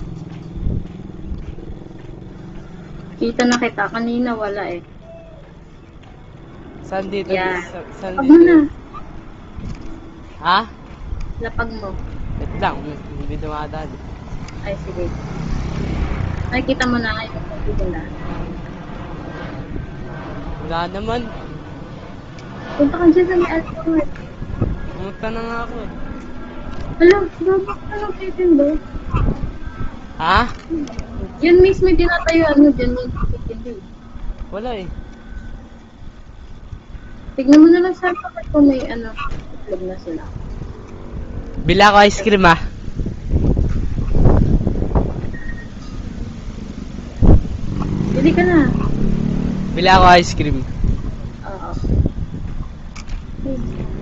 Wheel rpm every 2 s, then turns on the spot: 0, 0, 0, 0, 0, 0, 0, 0, 0, 0, 0, 0, 0, 0, 0, 0, 0, 0, 0, 0, 0, 0, 0, 0, 0, 0, 0.
none